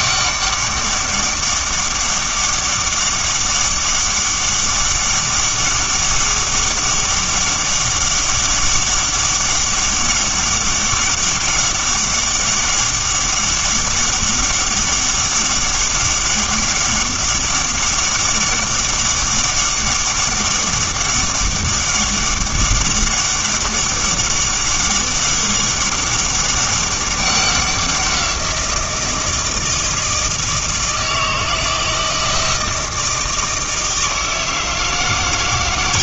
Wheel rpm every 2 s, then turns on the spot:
200, 200, 200, 200, 200, 200, 200, 200, 200, 200, 200, 200, 200, 200, 170, 160, 160, 160.
none